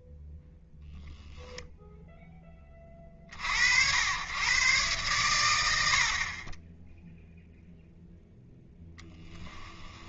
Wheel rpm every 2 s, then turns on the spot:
0, 20, 130, 10, 0.
none